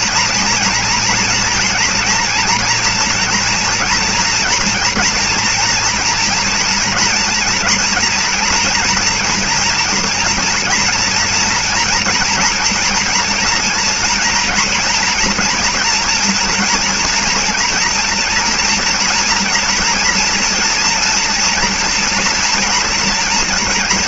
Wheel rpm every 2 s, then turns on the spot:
240, 230, 240, 230, 230, 230, 240, 240, 230, 230, 230, 230.
none